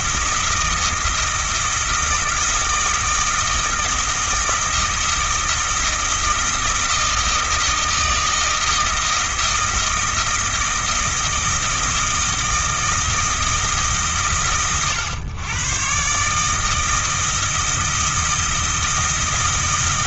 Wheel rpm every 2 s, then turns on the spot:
160, 160, 170, 160, 170, 160, 170, 120, 160, 160.
none